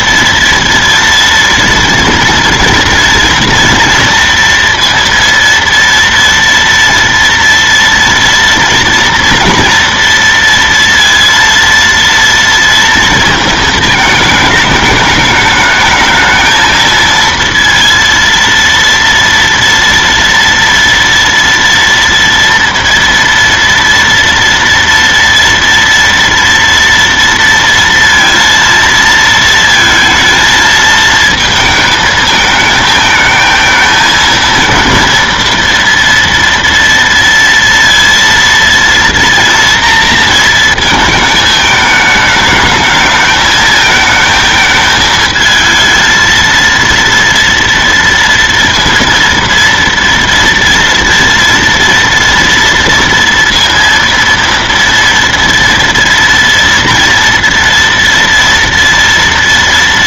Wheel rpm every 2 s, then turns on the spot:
230, 230, 230, 230, 230, 230, 230, 210, 220, 230, 230, 230, 230, 230, 230, 220, 220, 230, 230, 230, 230, 220, 220, 230, 230, 230, 230, 230, 230, 230.
none